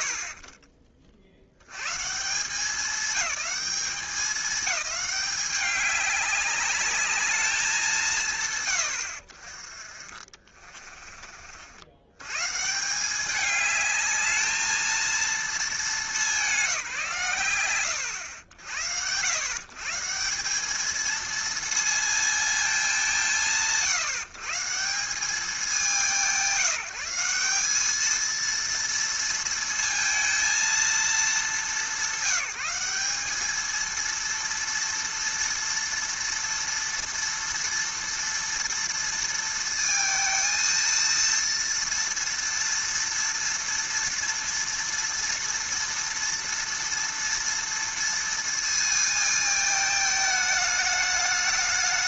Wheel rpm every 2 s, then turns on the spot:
60, 190, 210, 200, 130, 30, 140, 220, 180, 90, 200, 210, 140, 180, 230, 230, 180, 230, 230, 230, 230, 230, 230, 230, 230, 210.
10-12